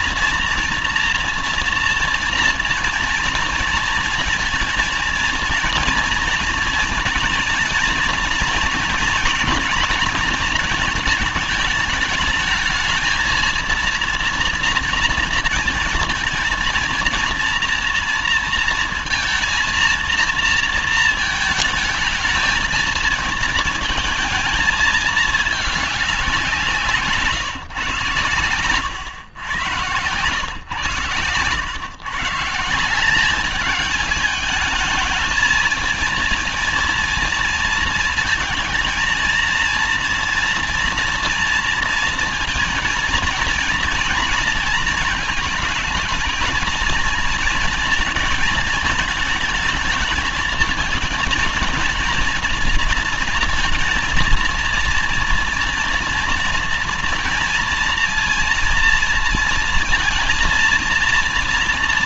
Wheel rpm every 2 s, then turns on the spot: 230, 230, 230, 230, 230, 220, 220, 230, 230, 230, 230, 220, 220, 180, 120, 120, 170, 210, 230, 220, 230, 230, 230, 220, 220, 230, 230, 230, 230, 230, 230.
none